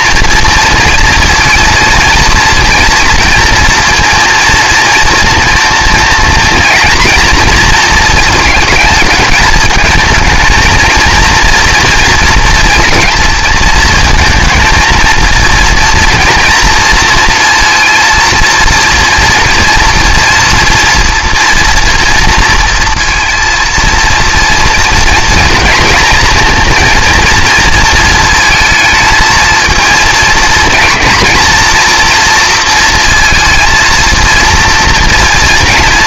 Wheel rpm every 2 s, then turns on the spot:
230, 230, 230, 230, 220, 220, 230, 230, 240, 230, 230, 230, 230, 240, 220, 230, 230, 230.
none